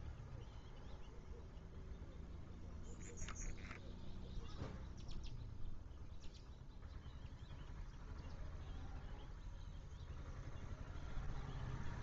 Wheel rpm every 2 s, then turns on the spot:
0, 0, 0, 0, 0, 0.
none